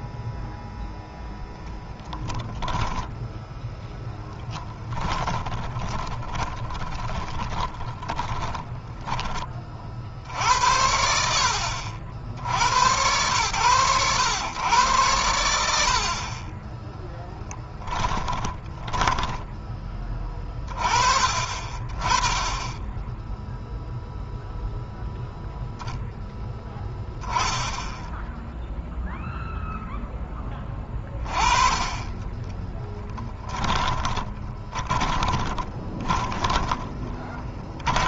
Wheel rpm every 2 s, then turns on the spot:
0, 10, 20, 20, 10, 70, 90, 110, 20, 20, 30, 10, 0, 10, 0, 20, 20, 20, 20.
4-10 16-20 32-38